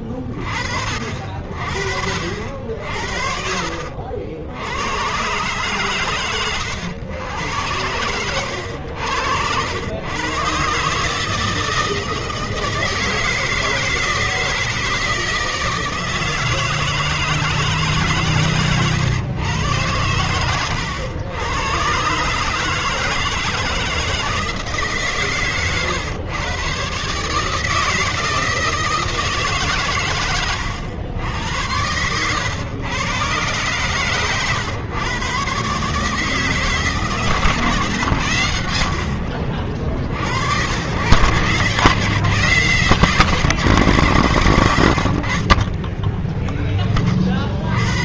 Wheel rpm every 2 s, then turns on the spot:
30, 60, 70, 120, 100, 120, 160, 160, 160, 140, 120, 140, 160, 120, 160, 110, 110, 120, 150, 100, 90, 160, 90, 10.
6-8 18-20